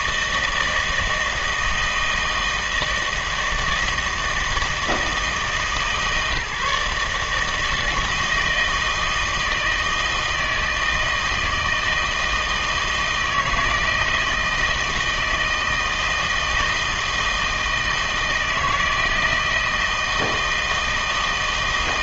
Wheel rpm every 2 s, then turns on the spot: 160, 160, 160, 150, 160, 160, 160, 160, 160, 160, 160.
none